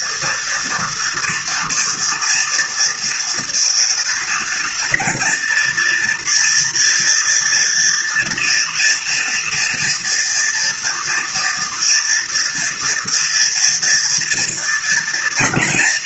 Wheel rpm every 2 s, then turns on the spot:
240, 230, 230, 240, 230, 230, 230, 240.
none